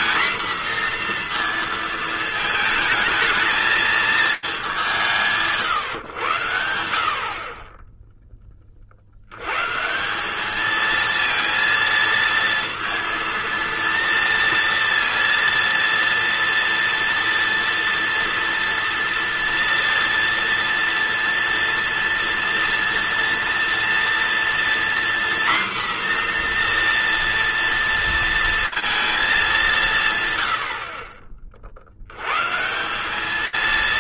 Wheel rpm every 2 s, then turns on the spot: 240, 220, 150, 70, 30, 210, 230, 230, 230, 230, 230, 240, 240, 240, 230, 70, 170.
none